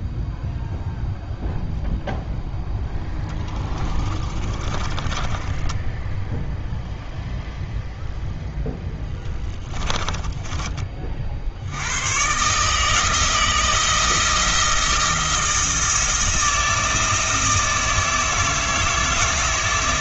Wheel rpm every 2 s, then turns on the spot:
0, 0, 20, 0, 0, 30, 150, 170, 160, 160.
4-6